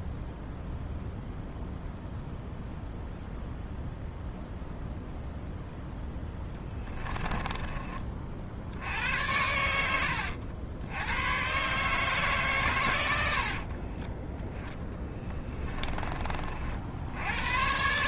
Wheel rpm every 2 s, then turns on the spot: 0, 0, 0, 10, 70, 90, 110, 10, 60.
6-8